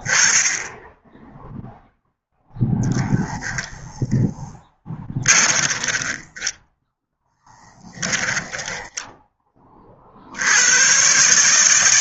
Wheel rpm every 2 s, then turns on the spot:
0, 0, 30, 0, 10, 130.
4-6